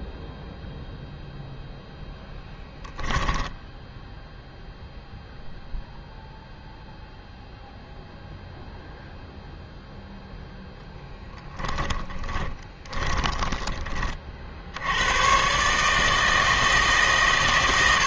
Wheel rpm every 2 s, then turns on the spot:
0, 0, 0, 0, 0, 0, 20, 70, 150.
12-14